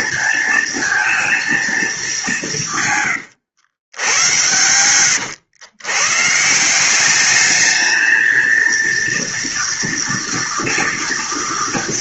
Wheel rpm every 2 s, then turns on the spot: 230, 170, 100, 150, 230, 230.
none